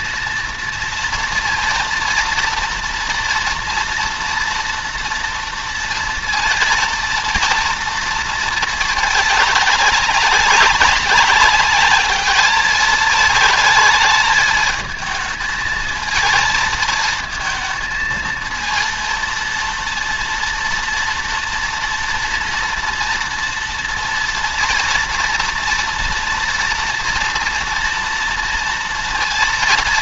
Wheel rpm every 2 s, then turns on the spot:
230, 230, 230, 230, 220, 200, 210, 220, 230, 230, 230, 230, 230, 230, 230.
none